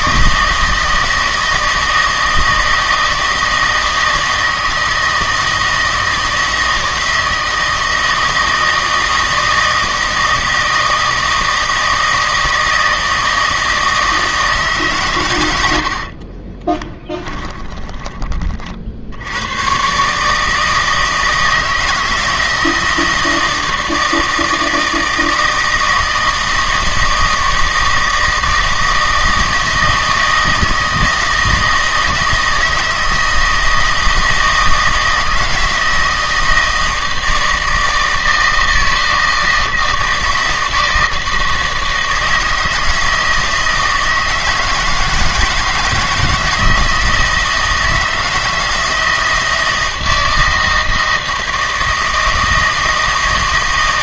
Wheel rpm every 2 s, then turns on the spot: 160, 160, 160, 160, 160, 160, 160, 150, 30, 40, 160, 160, 160, 160, 160, 160, 160, 160, 160, 160, 160, 160, 160, 160, 160, 160, 160.
16-18